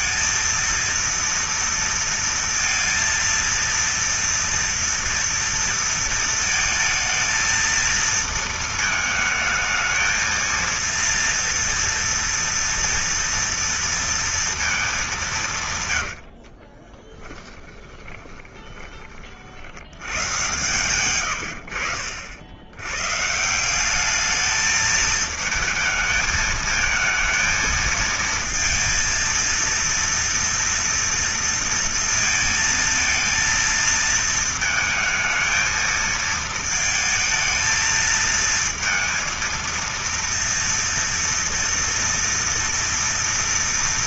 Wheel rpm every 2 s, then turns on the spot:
230, 230, 230, 220, 220, 230, 230, 220, 40, 20, 120, 100, 220, 220, 230, 230, 220, 220, 230, 230, 230, 230.
16-18